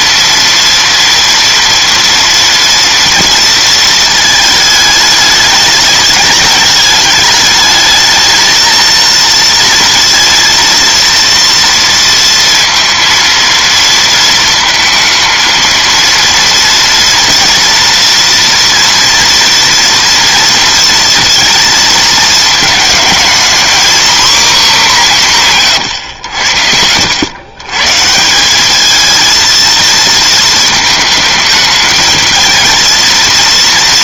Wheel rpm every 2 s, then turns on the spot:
230, 230, 220, 210, 220, 230, 230, 220, 230, 230, 230, 220, 240, 90, 200, 220, 230.
none